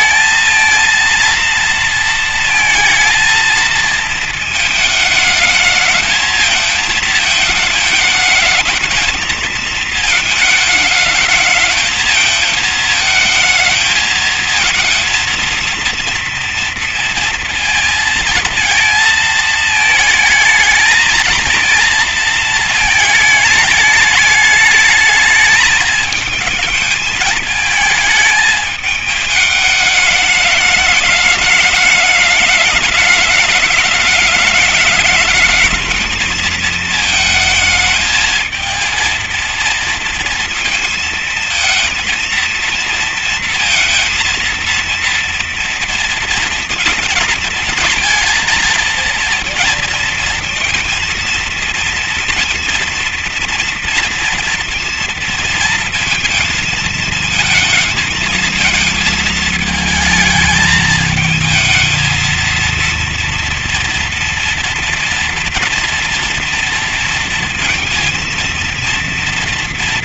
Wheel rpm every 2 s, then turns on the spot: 230, 230, 220, 220, 220, 220, 220, 230, 230, 230, 220, 220, 210, 220, 210, 210, 210, 210, 220, 220, 230, 230, 230, 230, 230, 230, 230, 230, 230, 220, 220, 230, 240, 230, 230.
none